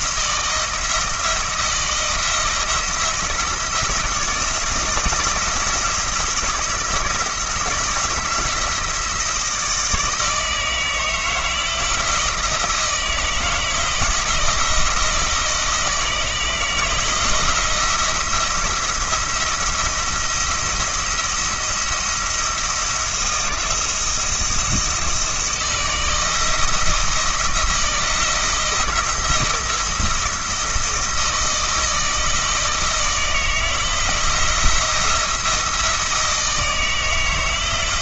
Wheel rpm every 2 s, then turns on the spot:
170, 170, 160, 170, 160, 160, 160, 160, 160, 170, 170, 170, 160, 160, 170, 160, 160, 170, 160.
none